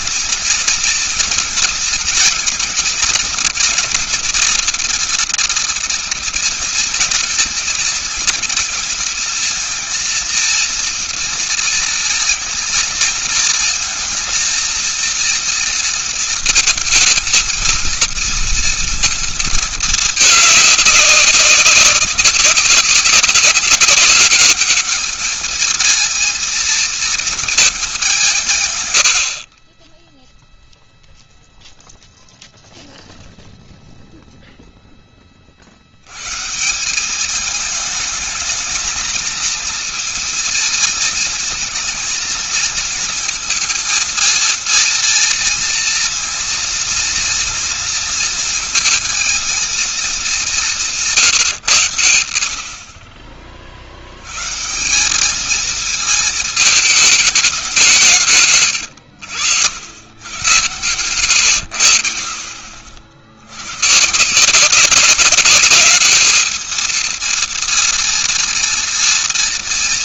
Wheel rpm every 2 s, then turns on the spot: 230, 230, 240, 220, 230, 230, 230, 230, 220, 230, 210, 200, 210, 230, 160, 0, 0, 0, 120, 220, 230, 230, 230, 240, 230, 190, 70, 120, 220, 150, 110, 60, 160, 220, 230.
58-60